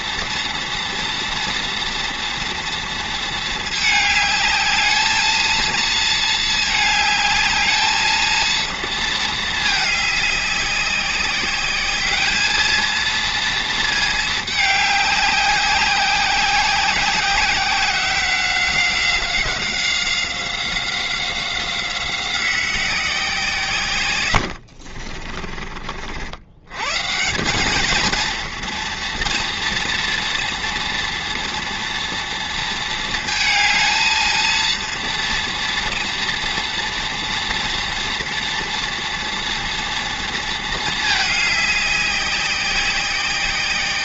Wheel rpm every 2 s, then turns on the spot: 230, 230, 210, 220, 220, 200, 220, 210, 190, 190, 180, 180, 80, 90, 230, 230, 230, 230, 230, 230, 220, 190.
24-26